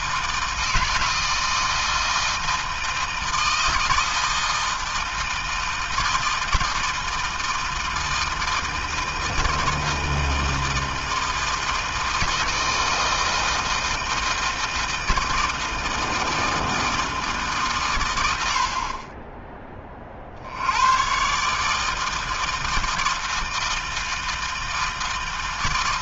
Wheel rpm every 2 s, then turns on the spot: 160, 160, 160, 160, 160, 160, 160, 160, 160, 30, 120, 160, 160.
none